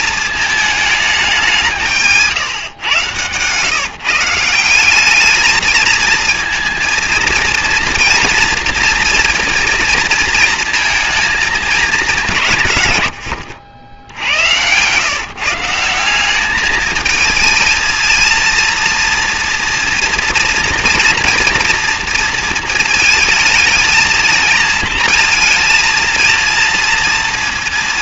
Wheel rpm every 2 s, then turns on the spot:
190, 130, 220, 230, 230, 220, 80, 150, 220, 240, 230, 220, 230, 230.
none